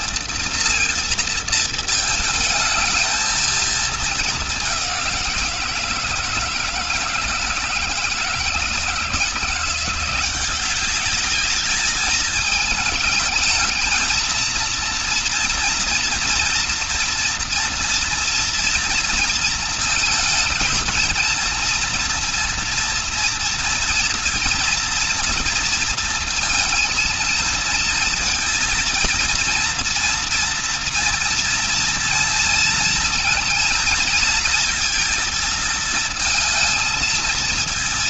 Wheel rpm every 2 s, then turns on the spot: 230, 220, 190, 160, 160, 200, 210, 230, 230, 230, 230, 230, 240, 230, 230, 230, 230, 230, 230.
none